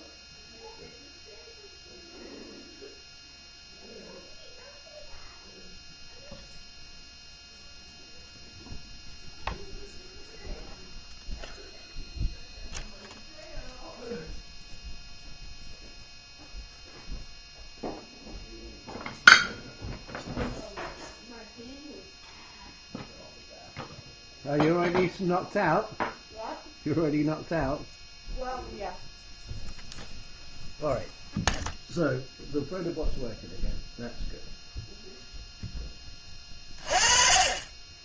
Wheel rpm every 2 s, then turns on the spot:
0, 0, 0, 0, 0, 0, 0, 0, 0, 0, 0, 0, 0, 0, 0, 0, 0, 0, 30.
none